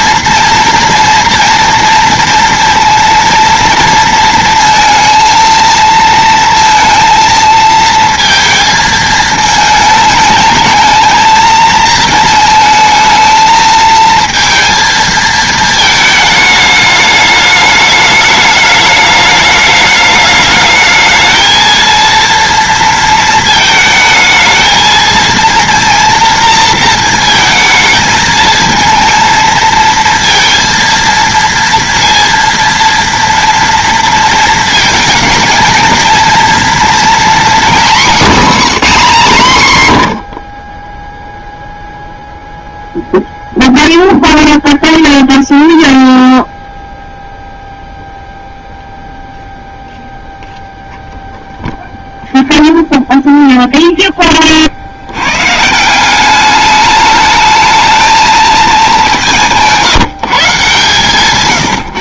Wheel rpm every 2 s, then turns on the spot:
230, 230, 230, 230, 230, 220, 230, 230, 220, 210, 210, 230, 220, 230, 220, 230, 230, 220, 230, 230, 40, 0, 0, 0, 0, 0, 0, 60, 210, 210, 140.
38-42